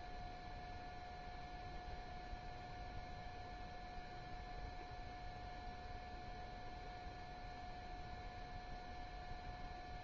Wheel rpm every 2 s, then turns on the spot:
0, 0, 0, 0, 0.
none